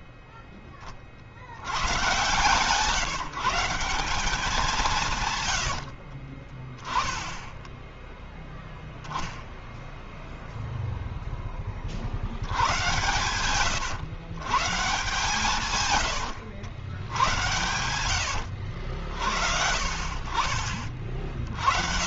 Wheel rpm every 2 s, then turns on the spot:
20, 150, 170, 10, 10, 0, 110, 150, 100, 60, 30.
none